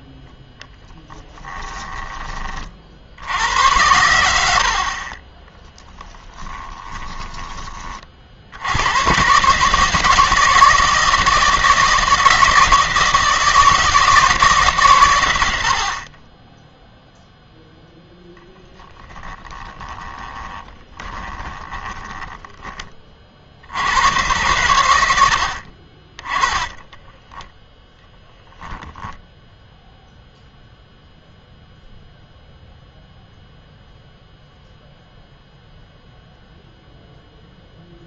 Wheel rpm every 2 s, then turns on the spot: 10, 40, 60, 20, 90, 160, 160, 130, 0, 10, 10, 20, 100, 20, 0, 0, 0, 0, 0.
0-2 4-8 18-22 26-28